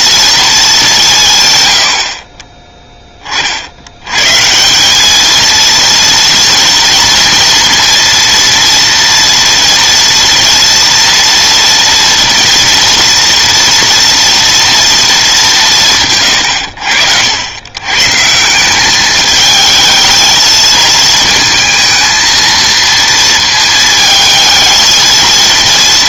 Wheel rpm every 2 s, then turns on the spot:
210, 10, 180, 230, 230, 240, 230, 230, 100, 180, 220, 230, 220.
none